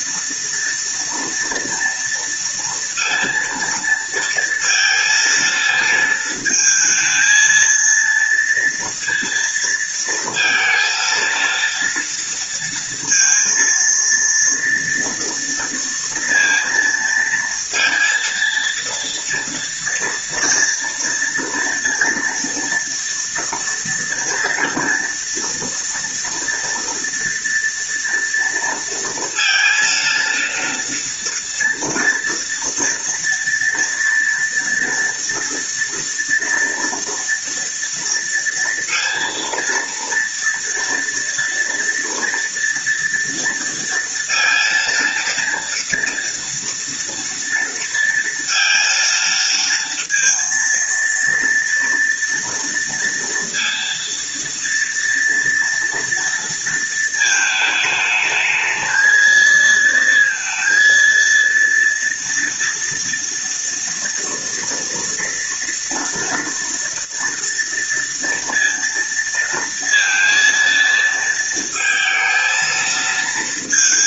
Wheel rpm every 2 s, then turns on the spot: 240, 230, 230, 220, 230, 230, 230, 230, 230, 230, 230, 230, 230, 230, 230, 230, 240, 240, 230, 230, 230, 230, 230, 230, 230, 230, 230, 230, 230, 220, 230, 230, 230, 230, 230, 230, 230.
none